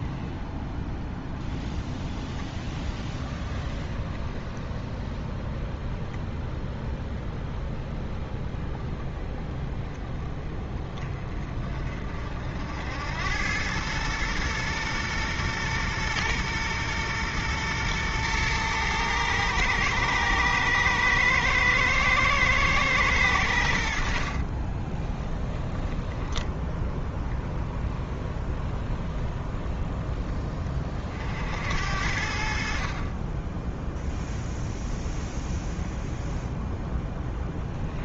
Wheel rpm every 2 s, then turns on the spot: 0, 20, 20, 20, 20, 30, 70, 120, 120, 110, 110, 110, 30, 10, 10, 30, 50, 0, 0.
24-26